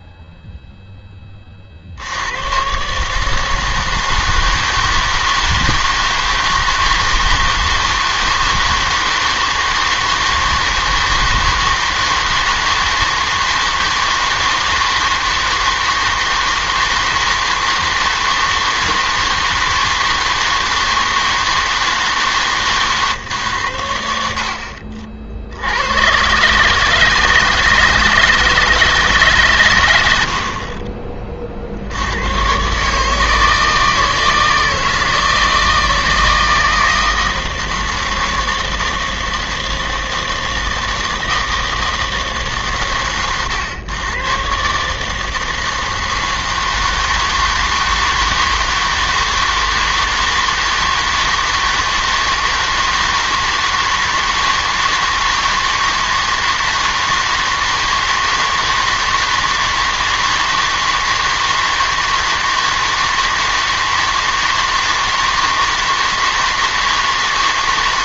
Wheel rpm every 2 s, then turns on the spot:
0, 130, 160, 160, 160, 160, 160, 160, 160, 160, 160, 140, 60, 140, 160, 40, 140, 160, 160, 160, 160, 130, 140, 160, 160, 160, 160, 160, 160, 160, 160, 160, 160, 160.
none